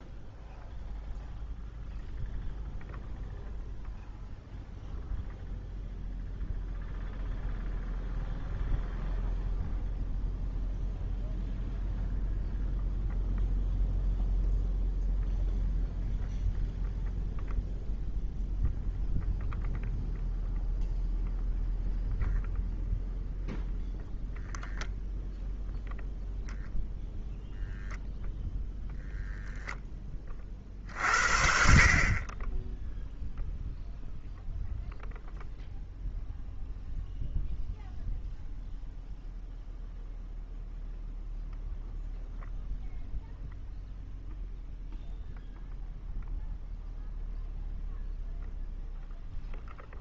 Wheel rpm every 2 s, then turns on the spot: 0, 0, 0, 0, 0, 0, 0, 0, 0, 0, 0, 0, 0, 0, 0, 30, 30, 0, 0, 0, 0, 0, 0, 0, 0.
none